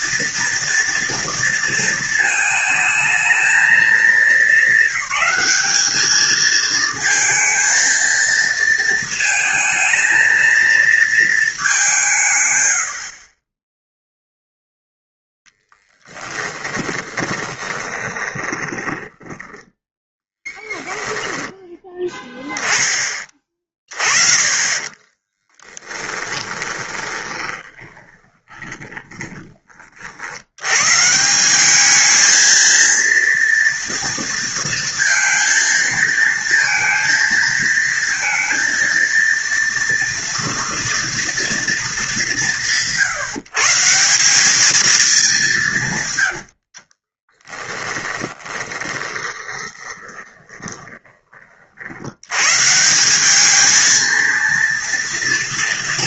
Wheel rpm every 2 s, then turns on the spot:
230, 220, 200, 220, 230, 230, 70, 0, 20, 20, 10, 10, 20, 20, 20, 120, 230, 230, 230, 230, 240, 160, 220, 40, 20, 20, 170, 230.
16-22 24-30 46-52